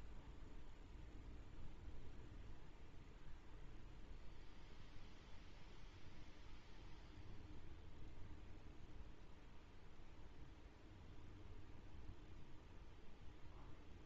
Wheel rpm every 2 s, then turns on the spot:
0, 0, 0, 0, 0, 0, 0.
none